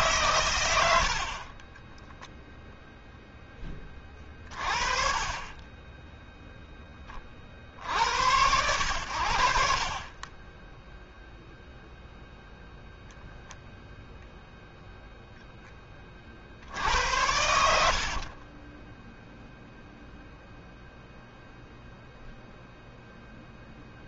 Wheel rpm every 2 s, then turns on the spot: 60, 10, 30, 50, 50, 0, 0, 10, 80, 0, 0, 0.
16-18